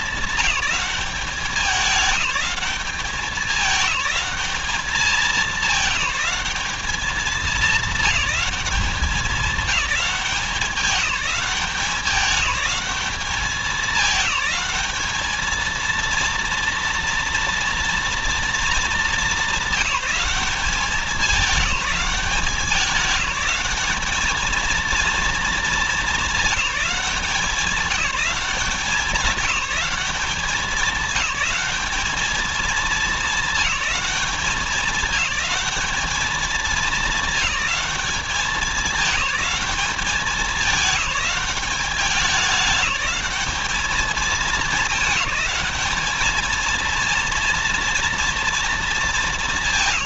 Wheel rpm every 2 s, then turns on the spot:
190, 200, 210, 210, 210, 200, 210, 210, 230, 230, 200, 200, 230, 210, 190, 190, 220, 210, 220, 190, 190, 200, 200, 220, 230.
none